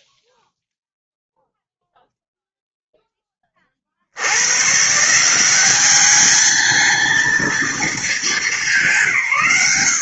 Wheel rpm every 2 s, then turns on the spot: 0, 0, 140, 220, 190.
none